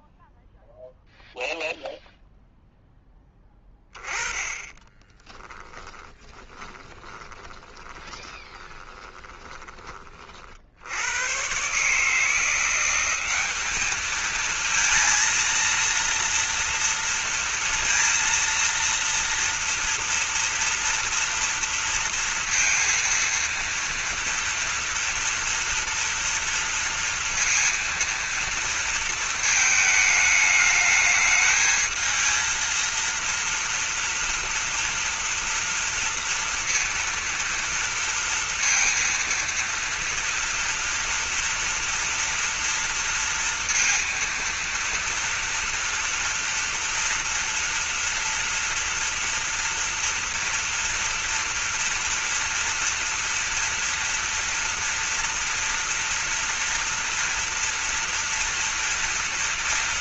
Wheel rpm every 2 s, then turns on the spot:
0, 0, 20, 20, 20, 70, 170, 220, 230, 230, 230, 230, 230, 230, 230, 210, 230, 230, 230, 230, 230, 230, 230, 230, 230, 230, 230, 230, 240, 230.
4-10